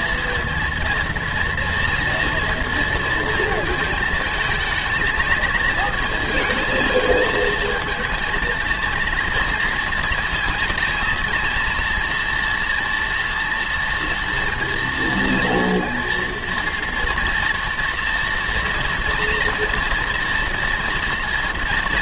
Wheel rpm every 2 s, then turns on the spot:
230, 230, 220, 220, 230, 230, 230, 230, 230, 230, 230.
none